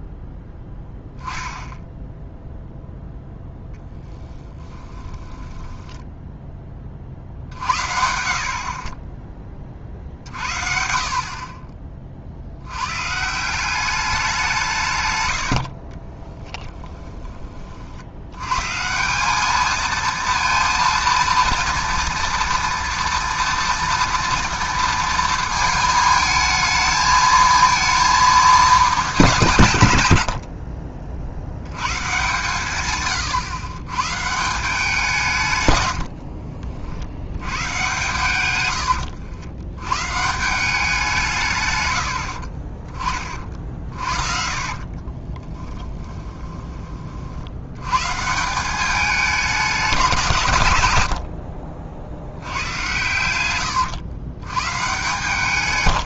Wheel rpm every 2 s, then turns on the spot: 10, 0, 20, 20, 30, 50, 110, 160, 20, 130, 230, 230, 230, 220, 210, 50, 130, 180, 70, 100, 180, 40, 40, 20, 190, 110, 90, 120.
4-6 16-18 38-40 42-46